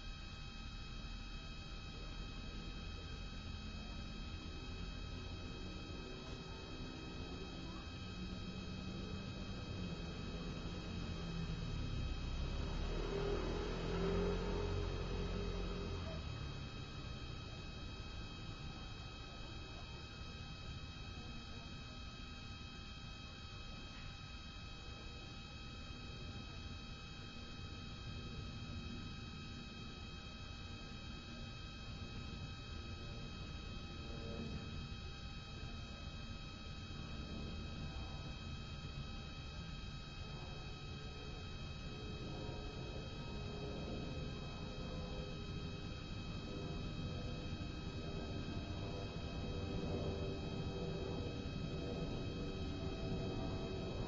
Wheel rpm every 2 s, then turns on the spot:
0, 0, 0, 0, 0, 0, 0, 0, 0, 0, 0, 0, 0, 0, 0, 0, 0, 0, 0, 0, 0, 0, 0, 0, 0, 0, 0.
none